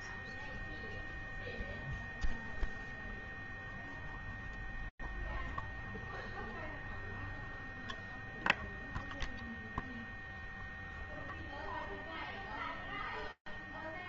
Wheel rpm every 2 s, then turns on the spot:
0, 0, 0, 0, 0, 0, 0.
none